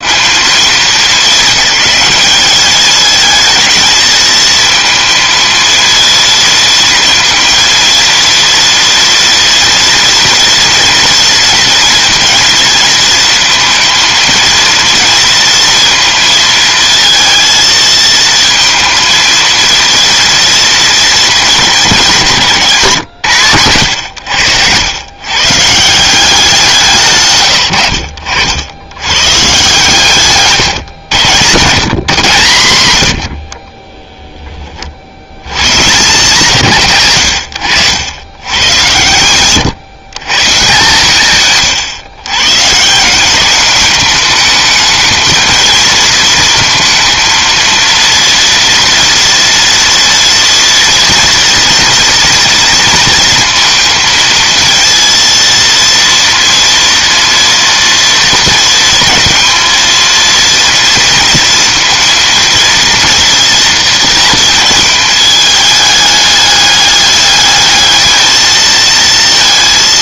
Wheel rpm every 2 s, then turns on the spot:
220, 210, 220, 230, 230, 230, 230, 230, 230, 230, 220, 140, 110, 160, 110, 120, 110, 60, 120, 110, 140, 170, 220, 230, 230, 230, 220, 230, 230, 220, 230, 230, 220, 210, 220.
none